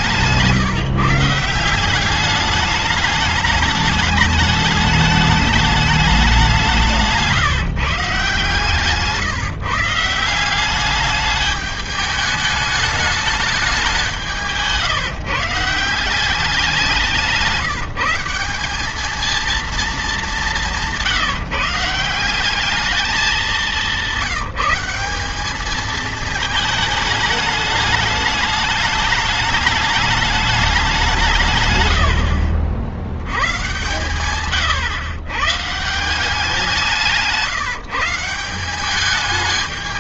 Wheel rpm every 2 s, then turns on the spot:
170, 210, 210, 160, 150, 210, 200, 160, 160, 220, 160, 200, 190, 210, 210, 150, 90, 130, 160, 190.
none